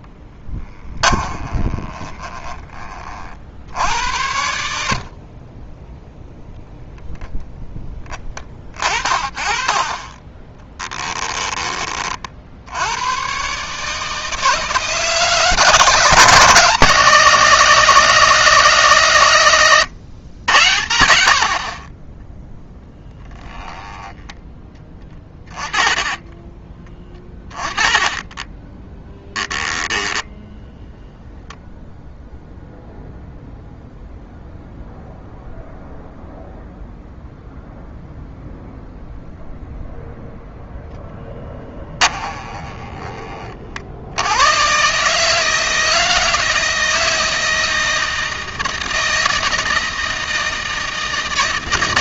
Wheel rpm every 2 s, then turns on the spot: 20, 30, 60, 0, 40, 10, 90, 160, 180, 150, 80, 10, 20, 20, 10, 0, 0, 0, 0, 0, 10, 20, 130, 160, 160, 160.
0-2 10-12 22-28 42-44